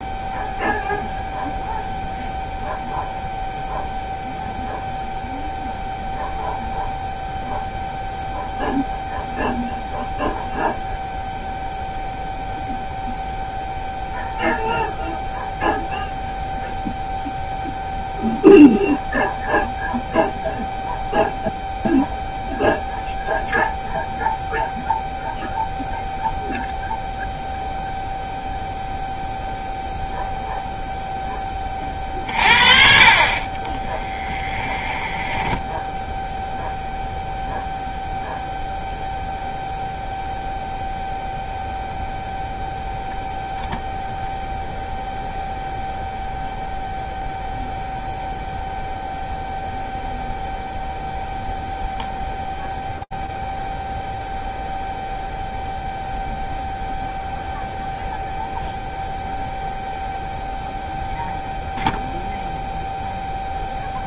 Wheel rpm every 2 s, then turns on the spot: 0, 0, 0, 0, 0, 0, 0, 0, 0, 0, 0, 0, 0, 0, 0, 0, 40, 10, 0, 0, 0, 0, 0, 0, 0, 0, 0, 0, 0, 0, 0, 0.
34-36